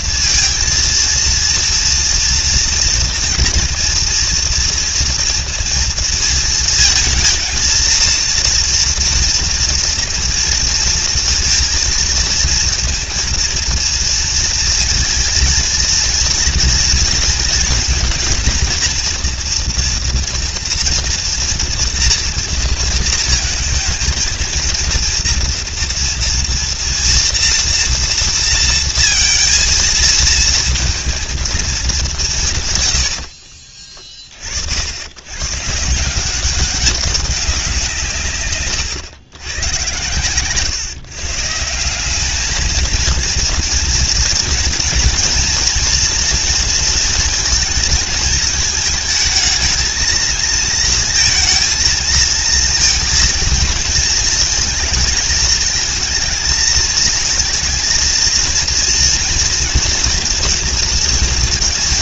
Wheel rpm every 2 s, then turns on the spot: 230, 230, 230, 230, 230, 230, 230, 230, 230, 230, 240, 230, 230, 230, 230, 220, 120, 90, 200, 110, 140, 230, 230, 230, 220, 230, 230, 230, 220, 230, 230.
none